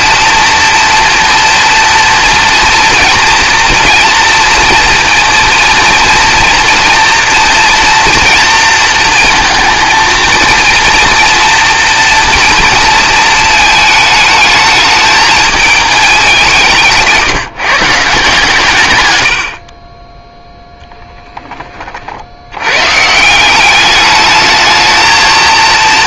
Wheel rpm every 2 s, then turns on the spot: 240, 230, 230, 230, 230, 230, 230, 210, 170, 130, 0, 120, 220.
none